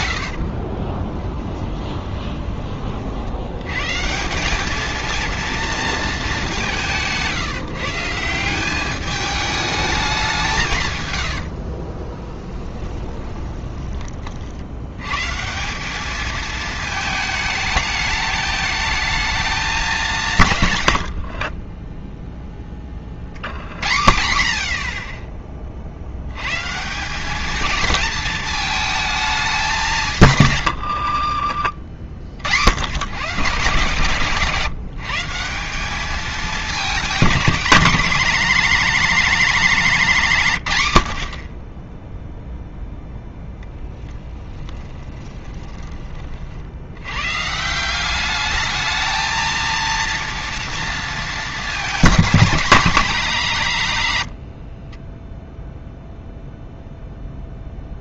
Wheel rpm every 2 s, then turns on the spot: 30, 40, 220, 170, 200, 120, 10, 110, 220, 220, 110, 30, 50, 150, 220, 70, 100, 160, 220, 220, 120, 0, 30, 90, 220, 230, 200, 40, 0.
0-2 12-14 20-22 30-32 44-46 54-56